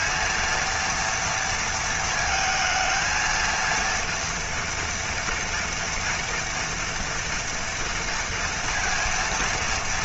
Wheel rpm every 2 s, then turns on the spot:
230, 220, 230, 230, 230.
none